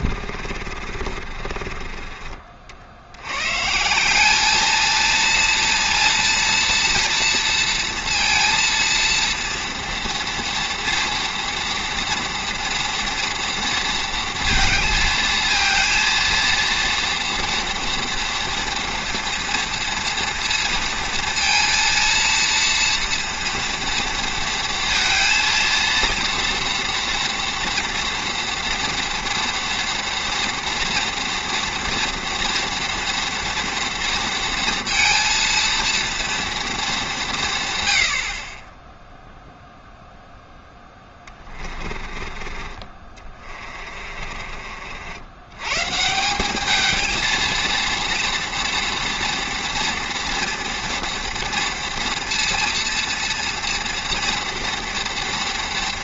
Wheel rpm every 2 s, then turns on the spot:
40, 60, 220, 230, 230, 230, 230, 230, 230, 230, 230, 230, 230, 230, 230, 230, 230, 230, 220, 20, 10, 30, 50, 210, 230, 230, 230, 230.
0-2 40-42